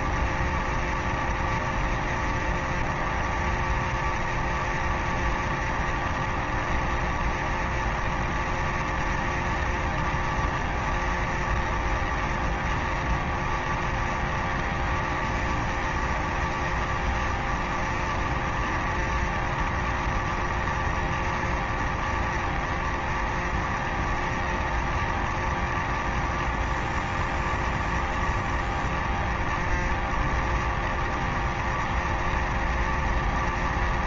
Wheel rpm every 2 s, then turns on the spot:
0, 0, 0, 0, 0, 0, 0, 0, 0, 0, 0, 0, 0, 0, 0, 0, 0.
none